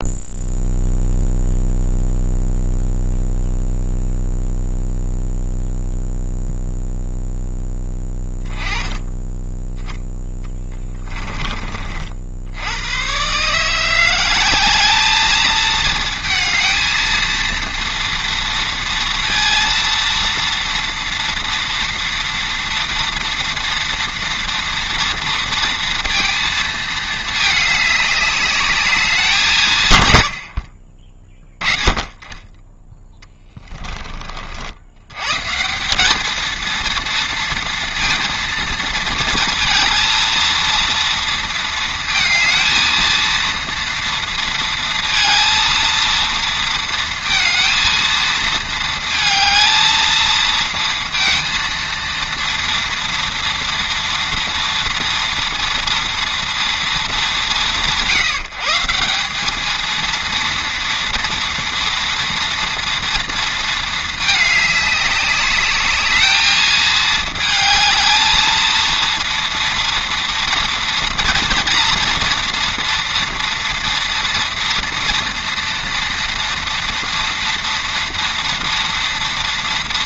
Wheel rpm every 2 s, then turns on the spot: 0, 0, 0, 0, 10, 30, 100, 210, 230, 230, 230, 230, 230, 220, 200, 50, 10, 70, 220, 230, 230, 220, 230, 230, 220, 230, 230, 240, 200, 170, 230, 230, 210, 220, 230, 230, 230, 230, 230, 230.
none